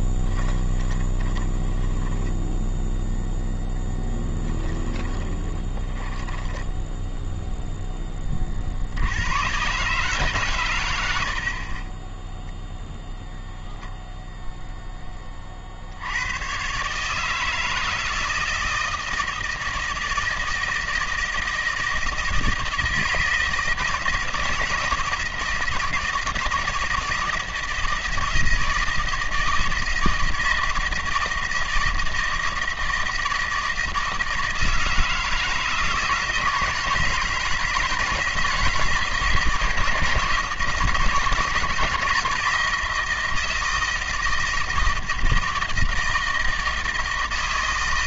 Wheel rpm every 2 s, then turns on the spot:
20, 10, 10, 10, 70, 100, 0, 10, 140, 160, 160, 160, 160, 160, 160, 160, 160, 160, 160, 160, 160, 170, 160, 160.
0-8